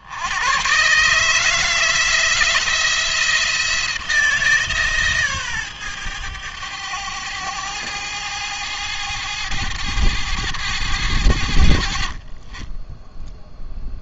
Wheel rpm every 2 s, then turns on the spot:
110, 160, 150, 110, 110, 100, 30.
none